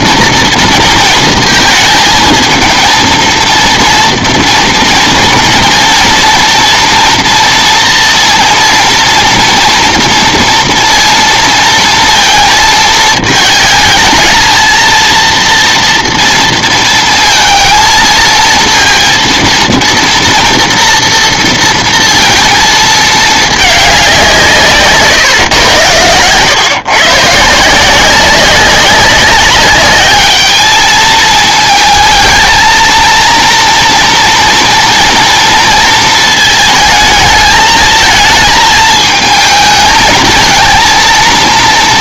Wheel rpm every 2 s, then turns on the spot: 230, 220, 240, 230, 230, 230, 230, 220, 230, 230, 230, 230, 160, 130, 190, 210, 220, 240, 220, 220, 220.
none